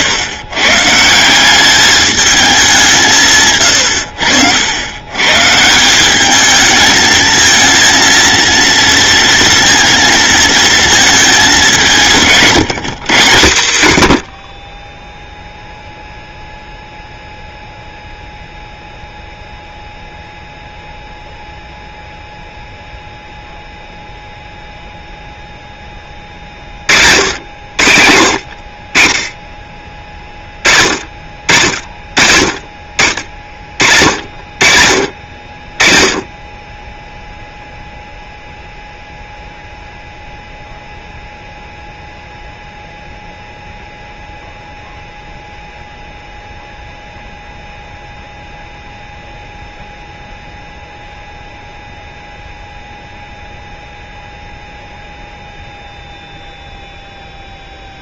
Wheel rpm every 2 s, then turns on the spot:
130, 200, 90, 220, 230, 220, 160, 20, 0, 0, 0, 0, 0, 40, 50, 20, 40, 50, 20, 0, 0, 0, 0, 0, 0, 0, 0, 0, 0.
none